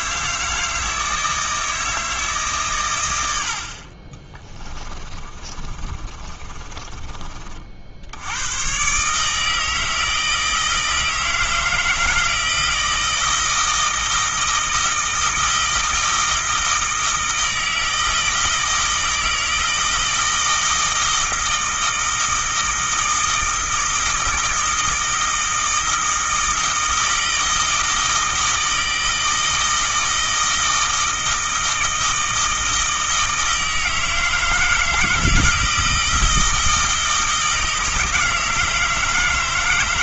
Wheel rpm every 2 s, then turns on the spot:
160, 130, 20, 30, 120, 160, 160, 160, 160, 160, 160, 160, 160, 160, 160, 160, 160, 160, 160, 160.
4-8